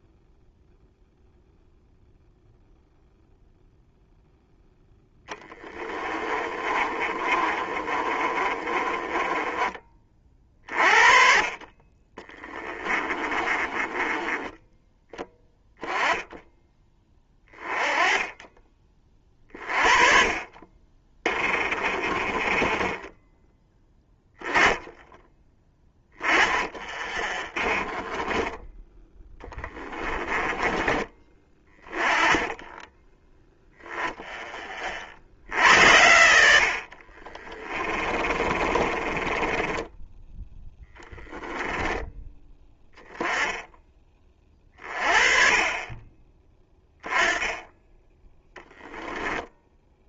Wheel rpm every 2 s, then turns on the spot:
0, 0, 0, 30, 20, 40, 20, 20, 20, 30, 20, 10, 10, 20, 10, 20, 10, 50, 50, 30, 10, 10, 30, 10, 10.
6-10 12-14 20-22 26-28 36-42 48-50